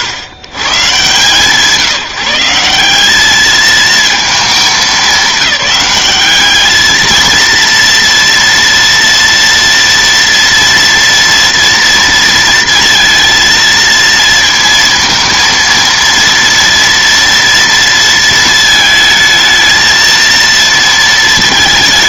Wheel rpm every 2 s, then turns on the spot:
130, 180, 200, 210, 240, 230, 230, 230, 230, 220, 230.
none